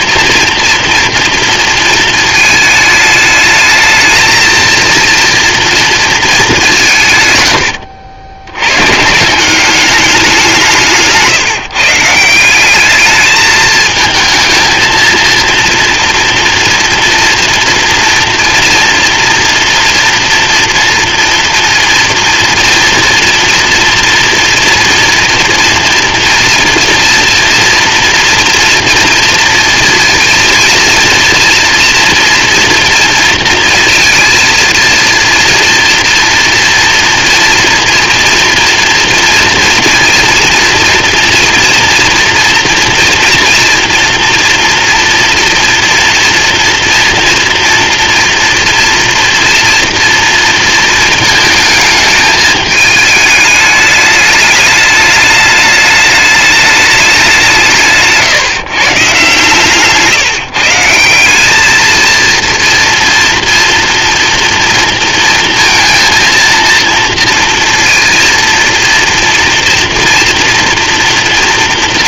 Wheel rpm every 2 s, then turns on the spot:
230, 220, 230, 190, 100, 190, 190, 220, 230, 230, 230, 230, 230, 230, 240, 230, 230, 230, 230, 230, 230, 230, 230, 230, 230, 230, 210, 210, 210, 140, 150, 230, 230, 230, 230, 230.
none